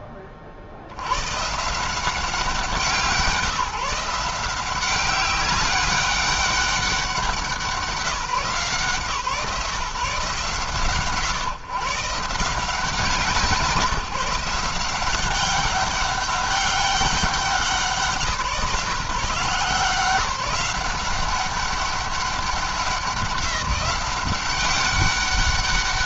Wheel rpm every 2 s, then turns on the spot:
40, 180, 180, 200, 160, 130, 170, 180, 200, 170, 180, 190, 200.
none